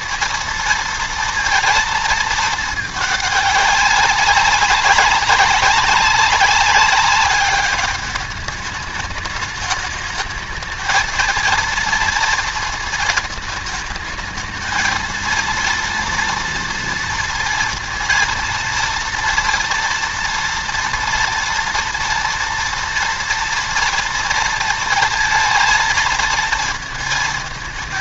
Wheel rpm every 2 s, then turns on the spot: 230, 220, 190, 200, 210, 220, 230, 220, 230, 230, 230, 240, 230, 220.
none